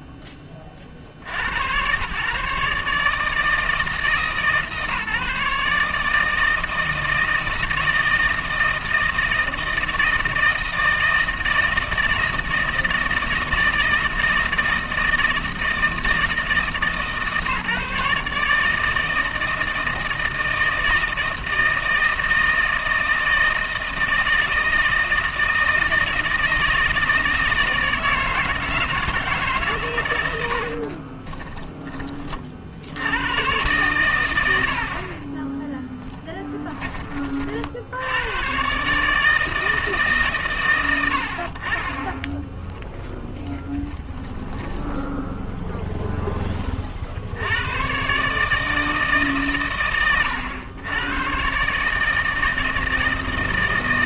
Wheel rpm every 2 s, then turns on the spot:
50, 160, 150, 160, 160, 160, 160, 160, 150, 160, 160, 160, 160, 160, 160, 30, 90, 50, 30, 150, 80, 10, 20, 30, 160, 110, 160.
30-32 44-46